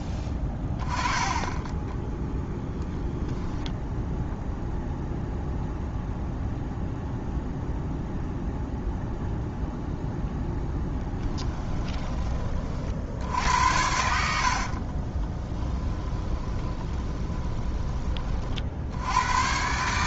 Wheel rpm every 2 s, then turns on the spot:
10, 10, 0, 0, 0, 0, 50, 50, 20, 70.
14-18